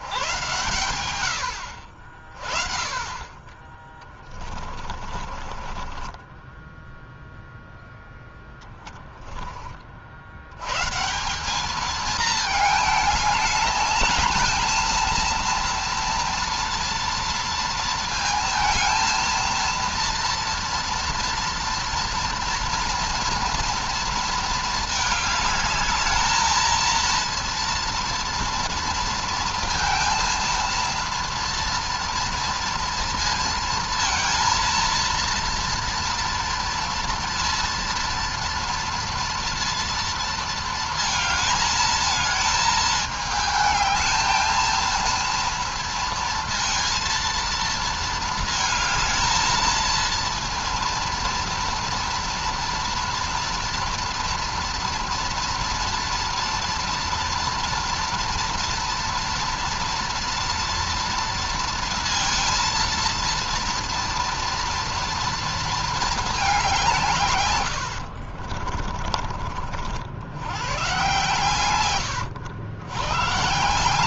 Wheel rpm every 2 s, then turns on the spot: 110, 30, 30, 10, 10, 140, 220, 230, 230, 230, 230, 230, 220, 230, 230, 230, 230, 230, 230, 230, 220, 220, 230, 230, 220, 230, 230, 230, 230, 230, 230, 230, 230, 170, 40, 120, 110.
4-8 68-70